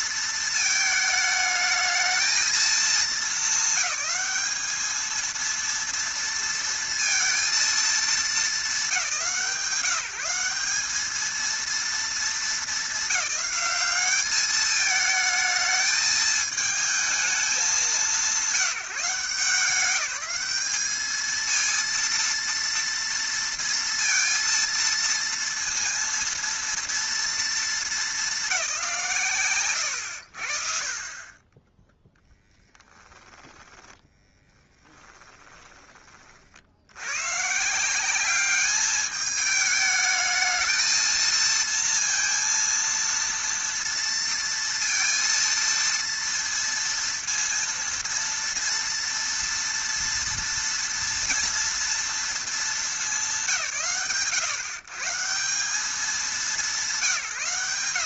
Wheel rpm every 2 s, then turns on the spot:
220, 230, 220, 230, 190, 200, 200, 210, 220, 180, 210, 230, 230, 230, 190, 50, 10, 10, 80, 210, 220, 230, 230, 230, 230, 230, 220, 140, 190.
32-36